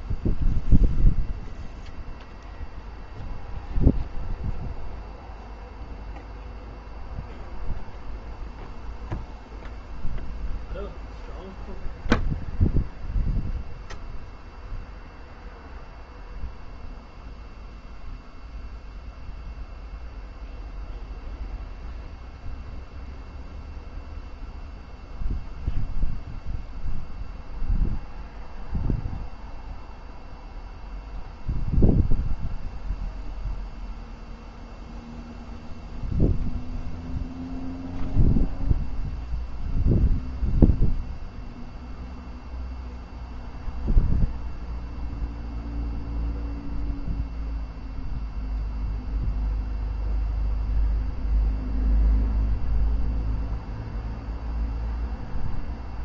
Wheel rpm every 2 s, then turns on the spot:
0, 0, 0, 0, 0, 0, 0, 0, 0, 0, 0, 0, 0, 0, 0, 0, 0, 0, 0, 0, 0, 0, 0, 0, 0, 0, 0, 0.
none